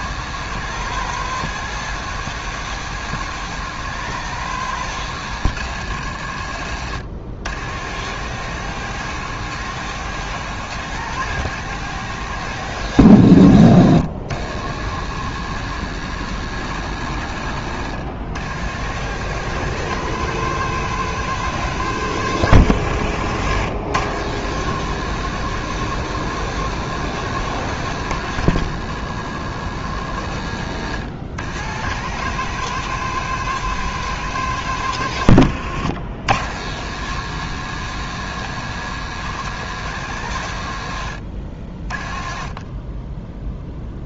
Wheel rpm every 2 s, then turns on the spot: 130, 130, 120, 70, 130, 130, 120, 100, 80, 100, 130, 90, 120, 130, 110, 80, 130, 110, 100, 130, 90, 20.
6-8 30-32